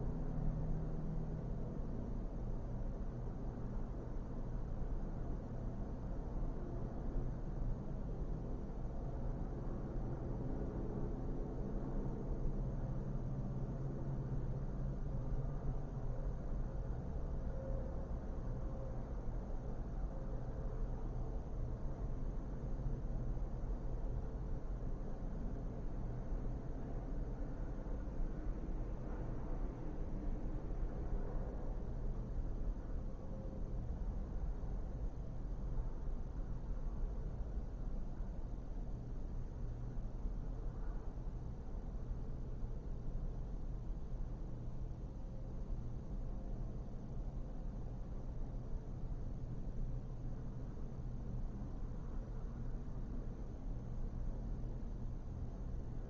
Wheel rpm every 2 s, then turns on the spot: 0, 0, 0, 0, 0, 0, 0, 0, 0, 0, 0, 0, 0, 0, 0, 0, 0, 0, 0, 0, 0, 0, 0, 0, 0, 0, 0, 0.
none